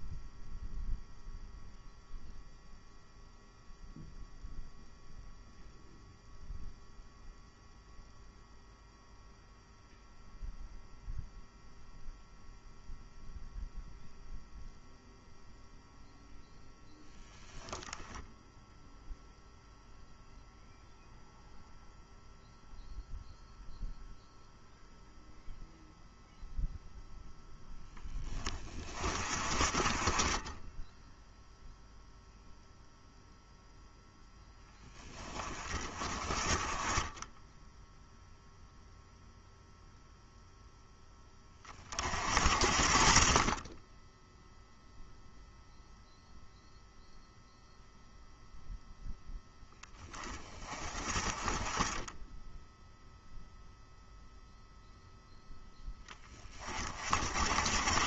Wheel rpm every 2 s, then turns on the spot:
0, 0, 0, 0, 0, 0, 0, 0, 0, 0, 0, 0, 0, 0, 30, 10, 0, 20, 30, 0, 10, 50, 0, 0, 0, 30, 0, 0, 40.
none